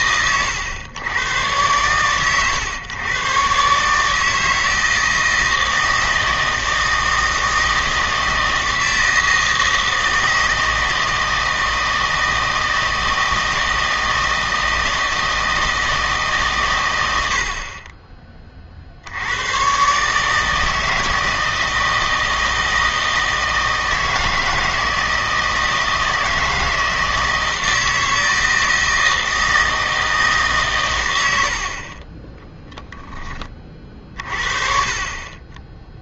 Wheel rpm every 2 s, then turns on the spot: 100, 120, 160, 160, 160, 160, 160, 160, 120, 40, 160, 160, 160, 160, 160, 140, 10, 40.
32-34